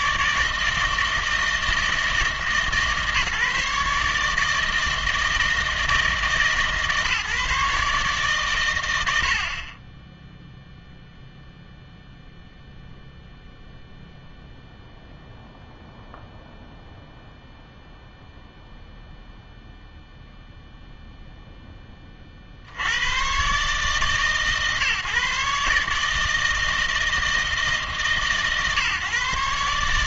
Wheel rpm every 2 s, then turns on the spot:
160, 160, 160, 150, 110, 0, 0, 0, 0, 0, 0, 70, 150, 160, 140.
none